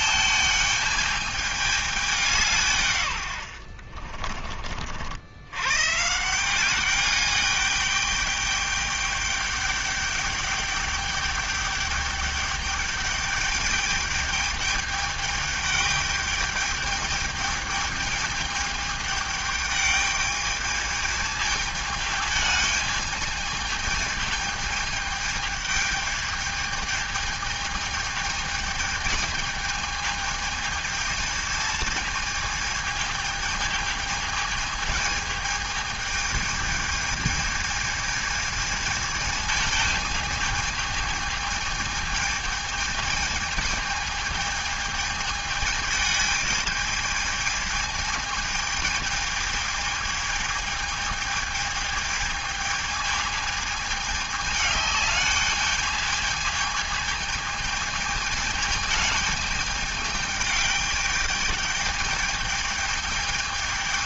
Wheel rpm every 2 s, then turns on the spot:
220, 150, 50, 190, 210, 210, 210, 210, 210, 210, 210, 220, 220, 220, 210, 220, 220, 220, 210, 220, 220, 220, 210, 220, 220, 220, 220, 210, 220, 210, 210, 210.
none